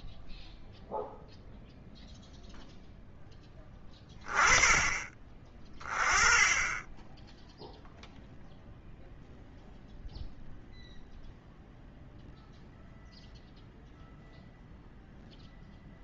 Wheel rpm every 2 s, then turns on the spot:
0, 0, 20, 10, 0, 0, 0, 0.
none